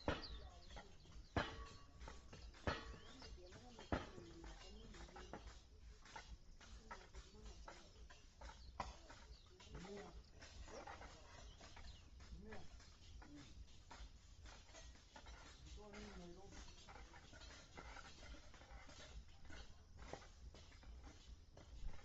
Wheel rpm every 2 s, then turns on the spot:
0, 0, 0, 0, 0, 0, 0, 0, 0, 0, 0.
none